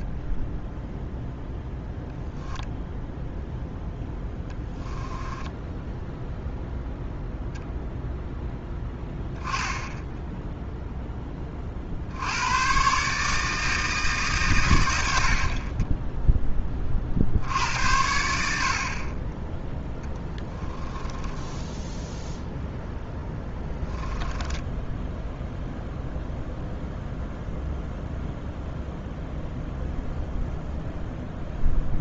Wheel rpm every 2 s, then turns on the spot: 0, 0, 10, 0, 10, 0, 140, 100, 30, 50, 20, 0, 10, 0, 0, 0.
4-6 20-22 24-26